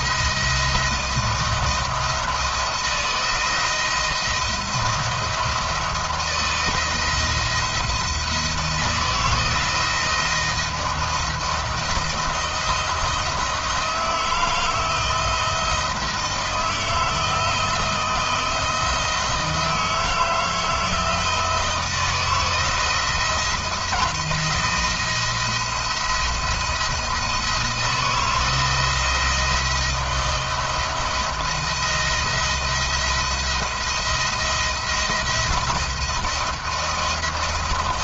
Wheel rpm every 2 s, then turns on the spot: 160, 160, 170, 170, 170, 170, 170, 160, 170, 160, 160, 160, 160, 170, 160, 170, 170, 170, 170.
none